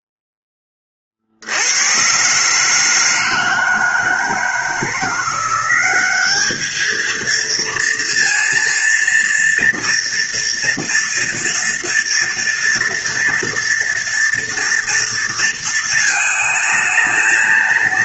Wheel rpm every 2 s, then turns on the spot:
10, 140, 160, 210, 230, 230, 230, 240, 220.
none